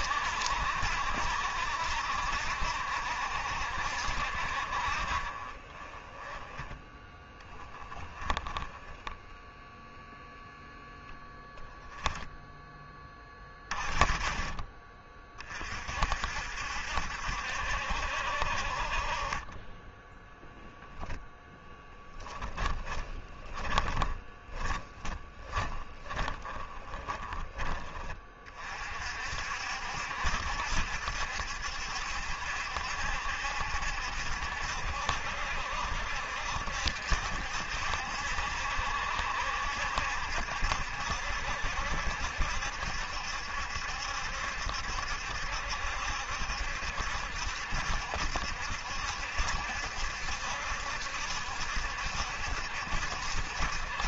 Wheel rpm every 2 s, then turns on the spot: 60, 70, 50, 10, 10, 0, 20, 30, 60, 40, 0, 10, 20, 20, 50, 70, 70, 60, 70, 70, 70, 70, 70, 70, 70, 70, 70.
22-28